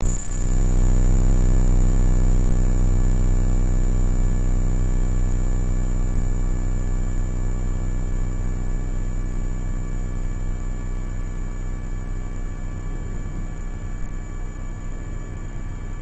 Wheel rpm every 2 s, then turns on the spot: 0, 0, 0, 0, 0, 0, 0, 0.
none